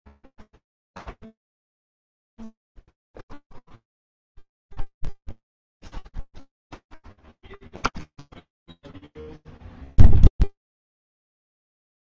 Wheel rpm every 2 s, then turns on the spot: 0, 0, 0, 0, 0, 0.
none